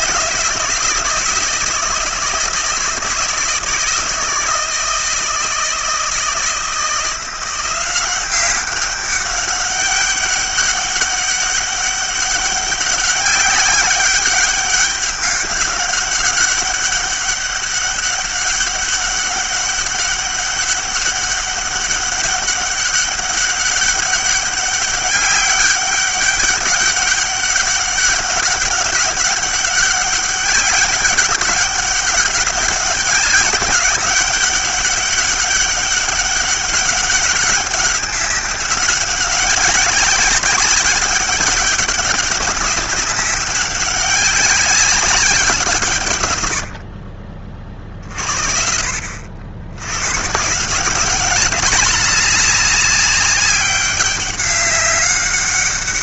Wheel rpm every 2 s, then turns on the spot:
160, 160, 160, 170, 190, 200, 200, 200, 200, 200, 200, 200, 200, 200, 190, 200, 200, 200, 200, 190, 200, 200, 200, 80, 60, 170, 200, 200.
none